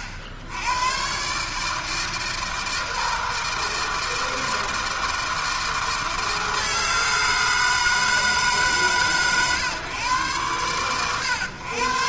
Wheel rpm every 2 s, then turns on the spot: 100, 160, 160, 160, 150, 100.
none